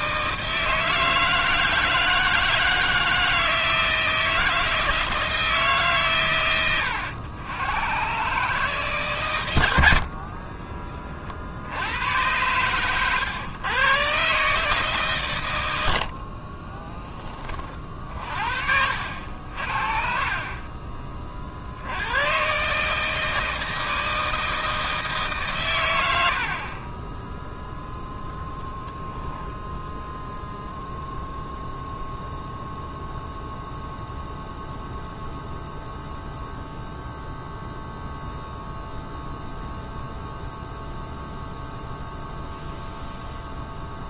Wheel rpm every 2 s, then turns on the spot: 160, 160, 160, 90, 140, 30, 110, 140, 20, 60, 30, 150, 160, 30, 0, 0, 0, 0, 0, 0, 0, 0.
none